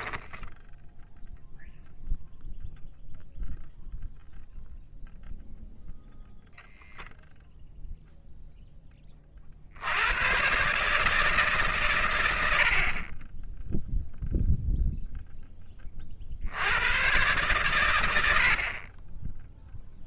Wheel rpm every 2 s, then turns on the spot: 10, 0, 0, 0, 40, 150, 20, 10, 120, 10.
none